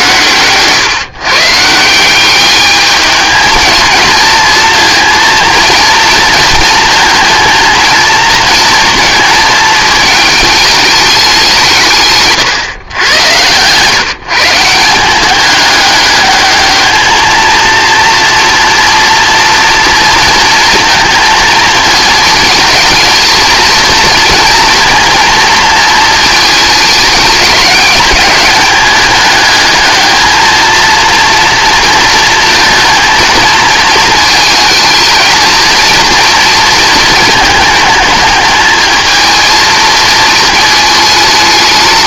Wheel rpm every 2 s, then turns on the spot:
140, 210, 220, 230, 230, 210, 140, 170, 210, 230, 230, 220, 230, 220, 200, 230, 230, 220, 230, 220, 220.
none